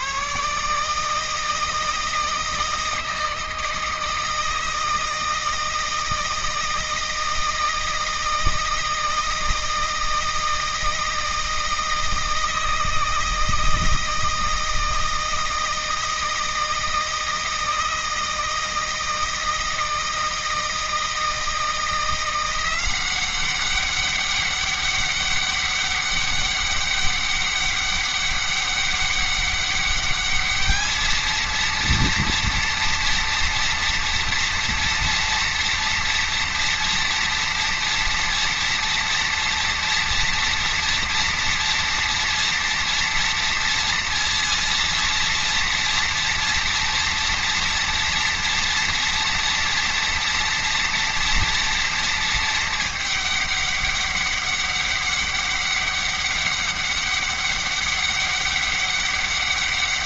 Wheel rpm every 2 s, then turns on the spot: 150, 160, 160, 160, 160, 160, 160, 160, 160, 160, 160, 180, 200, 200, 200, 220, 230, 230, 230, 230, 230, 230, 230, 230, 240, 230, 220, 200, 200, 200.
none